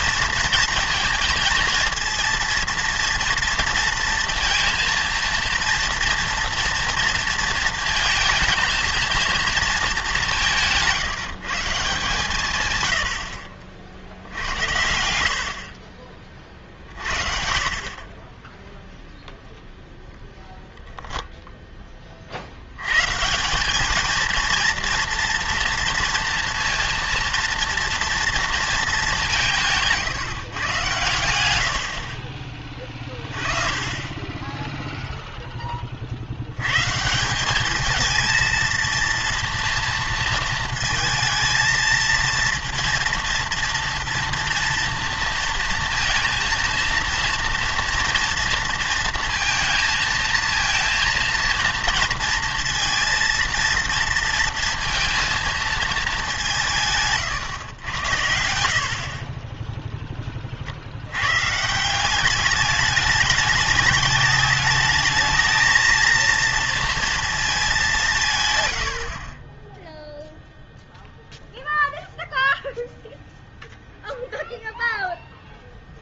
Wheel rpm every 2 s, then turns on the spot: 230, 230, 230, 230, 230, 180, 130, 80, 50, 10, 0, 70, 230, 230, 230, 130, 30, 10, 100, 230, 230, 230, 230, 230, 230, 230, 230, 230, 180, 70, 40, 200, 210, 230, 130, 0, 0, 0.
none